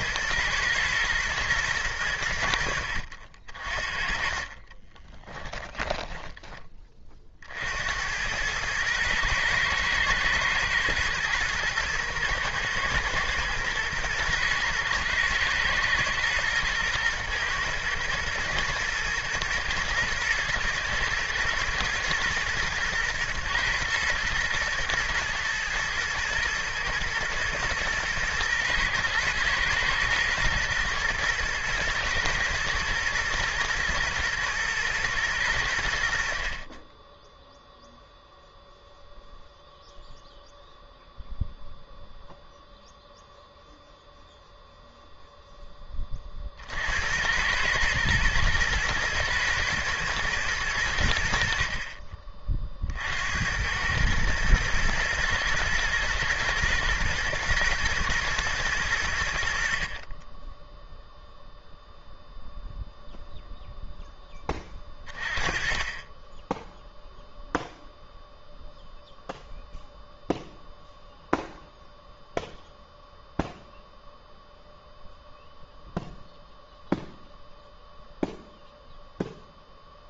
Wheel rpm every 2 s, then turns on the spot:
120, 70, 30, 20, 110, 110, 120, 110, 110, 110, 110, 120, 110, 110, 120, 120, 110, 110, 20, 0, 0, 0, 0, 60, 120, 100, 50, 110, 110, 100, 10, 0, 20, 0, 0, 0, 0, 0, 0, 0.
4-6